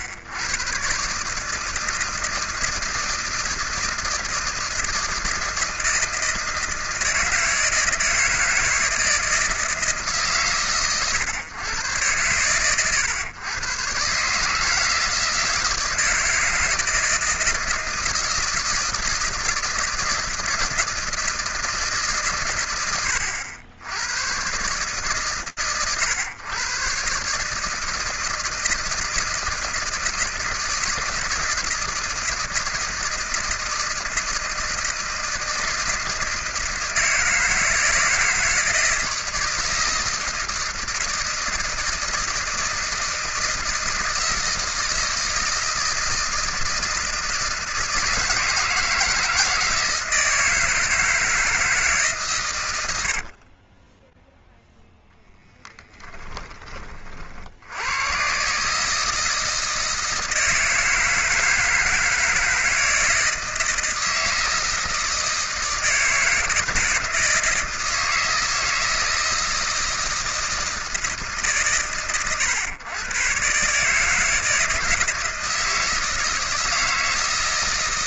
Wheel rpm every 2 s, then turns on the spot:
100, 160, 160, 160, 160, 150, 110, 140, 160, 160, 160, 130, 100, 120, 150, 160, 160, 160, 160, 170, 160, 160, 160, 160, 160, 160, 140, 0, 30, 130, 160, 160, 160, 160, 160, 160, 110, 160, 160.
none